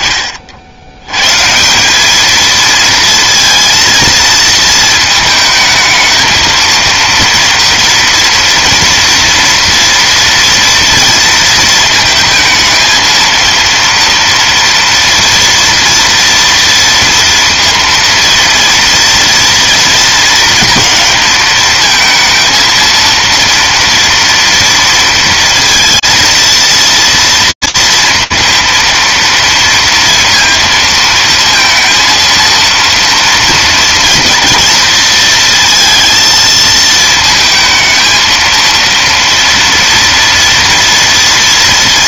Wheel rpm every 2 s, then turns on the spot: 20, 220, 230, 220, 230, 230, 220, 230, 230, 230, 230, 230, 230, 230, 230, 230, 230, 230, 230, 230, 240.
none